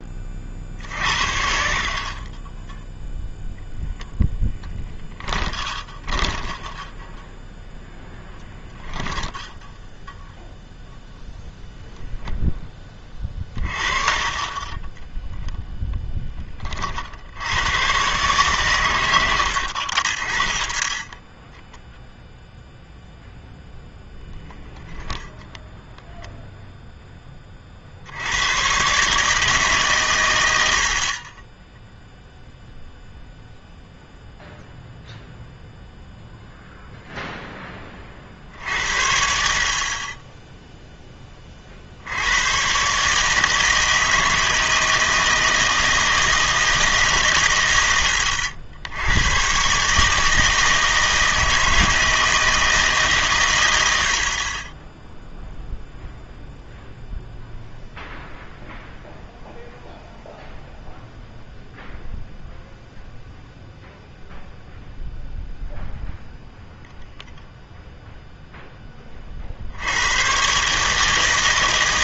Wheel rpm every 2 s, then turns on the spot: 60, 10, 0, 10, 10, 0, 10, 20, 30, 120, 20, 0, 0, 0, 120, 70, 0, 0, 0, 60, 0, 120, 160, 160, 80, 160, 160, 20, 0, 0, 0, 0, 0, 0, 0, 140.
6-10 14-16 30-32